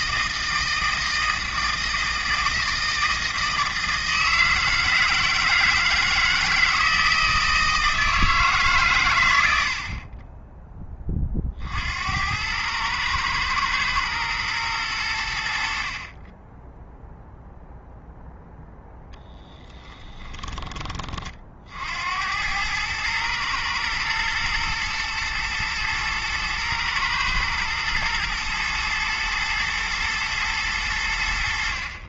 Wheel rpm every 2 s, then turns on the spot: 160, 160, 160, 160, 130, 20, 110, 110, 10, 10, 30, 110, 110, 120, 110, 100.
18-20